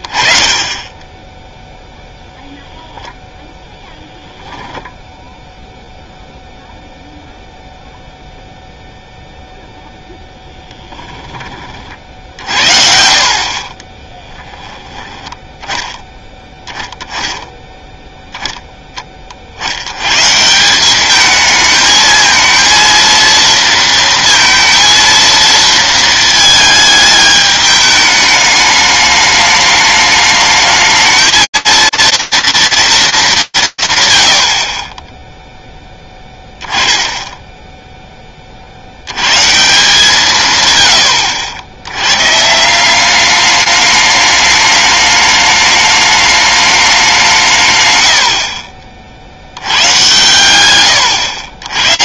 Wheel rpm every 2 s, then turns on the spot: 20, 0, 10, 0, 0, 10, 60, 10, 10, 0, 160, 220, 230, 220, 210, 210, 230, 80, 10, 30, 130, 160, 210, 210, 40, 120.
10-12